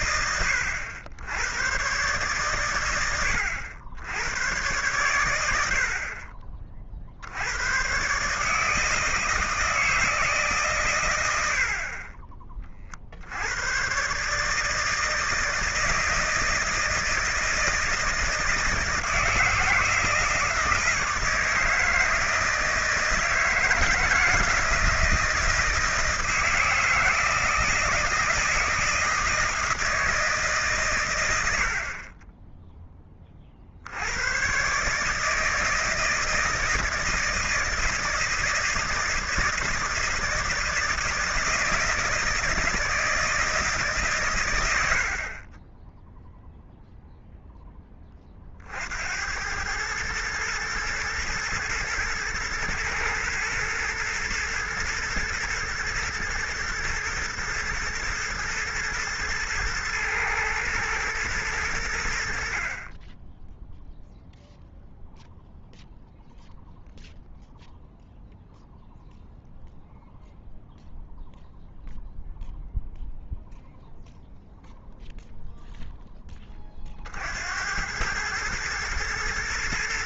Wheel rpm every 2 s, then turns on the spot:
100, 120, 110, 40, 150, 150, 40, 150, 160, 160, 160, 160, 160, 160, 160, 150, 20, 120, 160, 160, 160, 160, 110, 0, 40, 110, 120, 120, 120, 110, 110, 50, 0, 0, 0, 0, 0, 0, 20, 110.
none